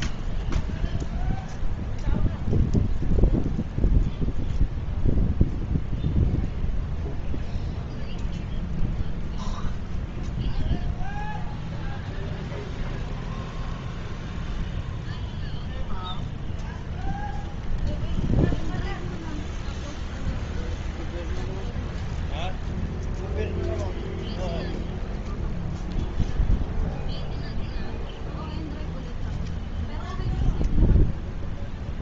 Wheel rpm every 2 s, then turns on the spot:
0, 0, 0, 0, 0, 0, 0, 0, 0, 0, 0, 0, 0, 0, 0, 0.
none